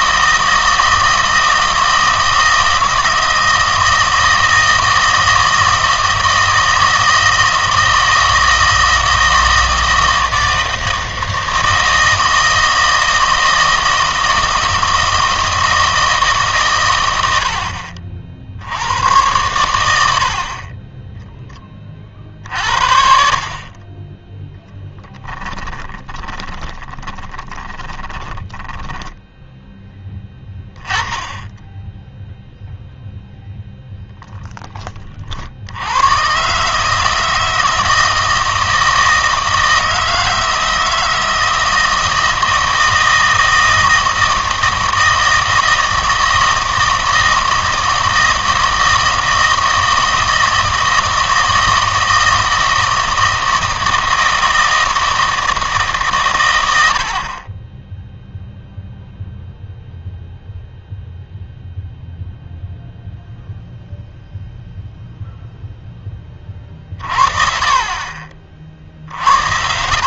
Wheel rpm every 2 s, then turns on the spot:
160, 160, 160, 160, 160, 160, 160, 160, 120, 90, 20, 60, 10, 20, 20, 10, 0, 20, 150, 160, 160, 160, 160, 160, 160, 160, 160, 160, 90, 0, 0, 0, 0, 40, 50.
24-30